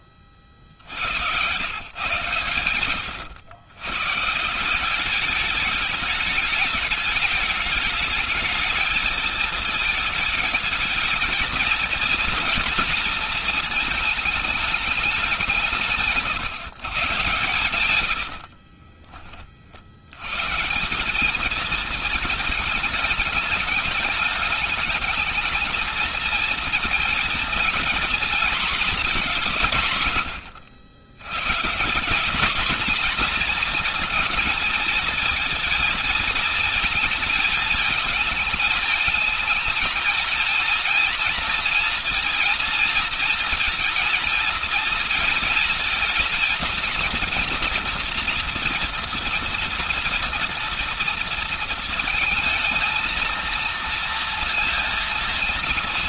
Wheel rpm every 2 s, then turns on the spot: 50, 120, 180, 210, 220, 220, 230, 210, 130, 40, 170, 210, 210, 230, 240, 110, 230, 220, 220, 220, 230, 240, 230, 230, 230, 230, 220, 230.
2-4 18-20